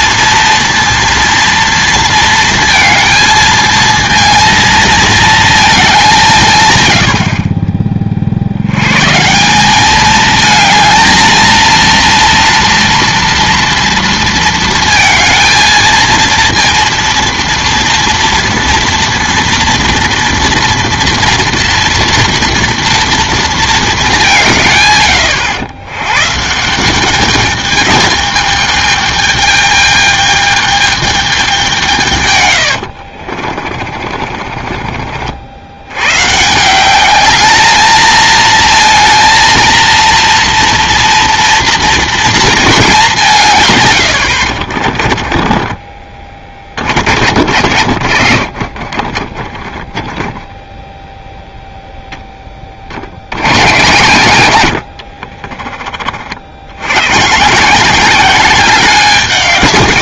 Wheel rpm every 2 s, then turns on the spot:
230, 230, 220, 100, 120, 220, 230, 230, 230, 230, 230, 230, 130, 180, 210, 220, 90, 40, 180, 230, 230, 200, 40, 40, 50, 10, 40, 80, 90, 190.
32-36 44-46 54-56